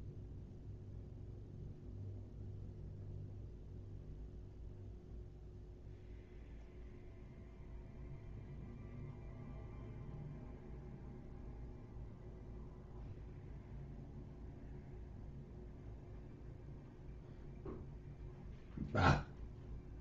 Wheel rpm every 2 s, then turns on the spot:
0, 0, 0, 0, 0, 0, 0, 0, 0, 0.
none